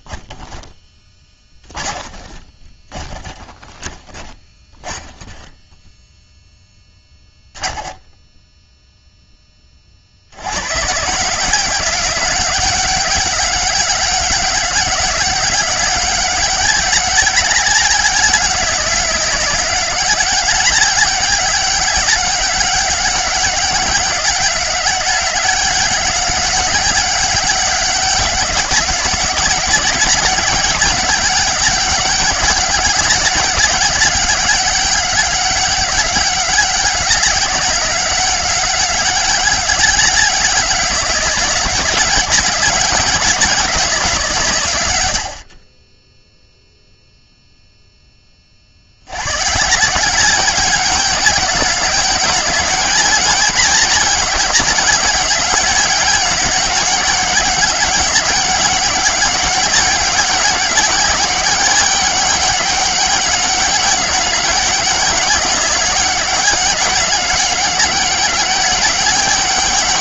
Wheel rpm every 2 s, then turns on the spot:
30, 20, 0, 0, 100, 190, 200, 190, 200, 200, 200, 200, 200, 200, 190, 200, 190, 200, 200, 190, 200, 180, 20, 0, 160, 200, 200, 200, 200, 200, 200, 200, 190, 200, 200.
0-4 44-46